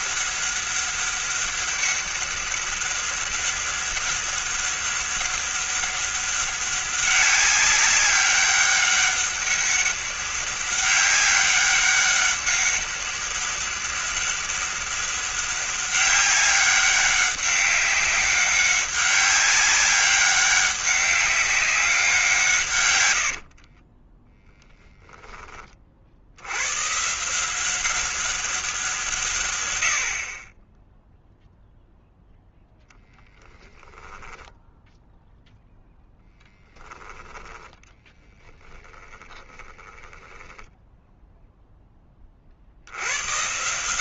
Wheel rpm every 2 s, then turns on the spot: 200, 200, 200, 200, 200, 190, 200, 200, 190, 200, 200, 120, 10, 120, 170, 10, 0, 0, 10, 10, 10, 70.
38-42